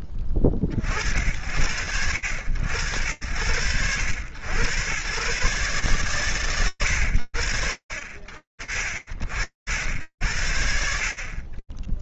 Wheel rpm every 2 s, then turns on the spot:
70, 80, 130, 50, 80, 60.
none